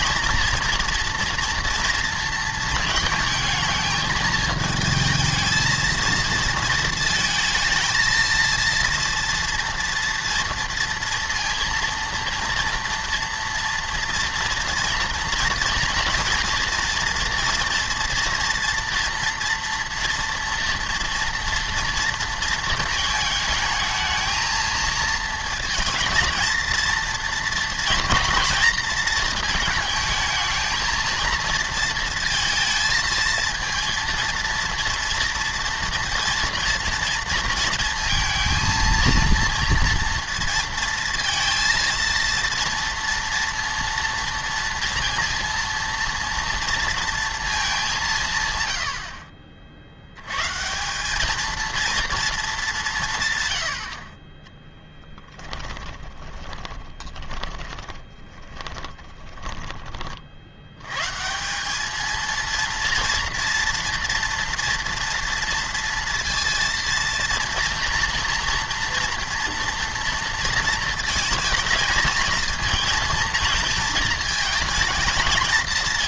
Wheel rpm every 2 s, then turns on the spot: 240, 220, 220, 230, 230, 230, 230, 230, 230, 230, 230, 230, 230, 230, 230, 230, 230, 230, 230, 230, 230, 230, 230, 230, 120, 150, 200, 10, 20, 10, 90, 230, 230, 230, 230, 230, 230, 220.
54-60